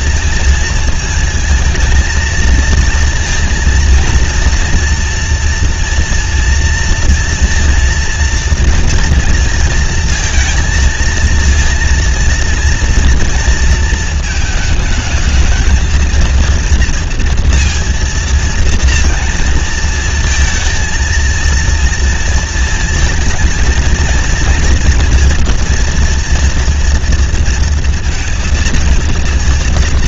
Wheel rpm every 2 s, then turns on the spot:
230, 220, 230, 230, 230, 230, 230, 220, 230, 230, 230, 230, 230, 230, 230.
none